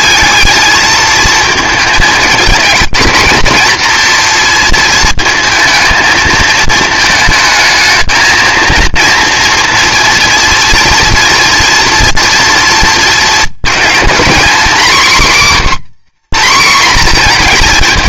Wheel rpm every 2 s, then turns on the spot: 220, 220, 230, 220, 230, 240, 230, 250, 240.
none